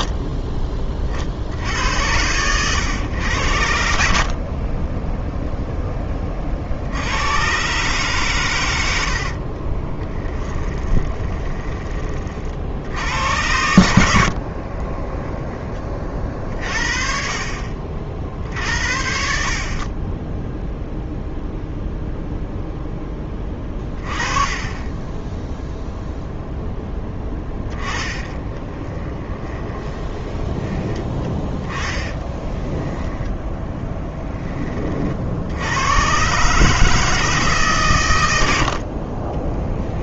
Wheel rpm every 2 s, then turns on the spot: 40, 100, 10, 90, 70, 20, 100, 10, 40, 70, 0, 10, 10, 10, 20, 10, 10, 60, 160, 30.
8-12 14-16 24-26 28-30 38-40